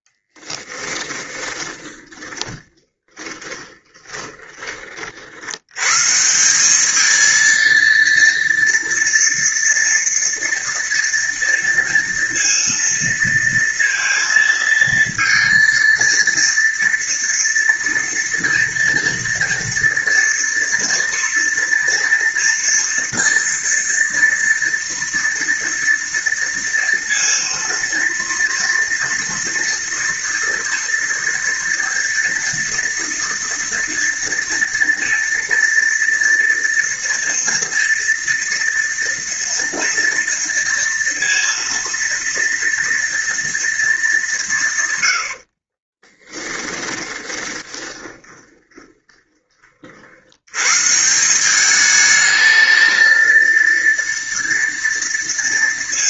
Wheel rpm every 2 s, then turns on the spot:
20, 20, 30, 190, 230, 230, 230, 230, 230, 230, 230, 230, 230, 230, 230, 230, 230, 230, 230, 230, 230, 230, 140, 20, 20, 130, 220, 230.
0-4 46-50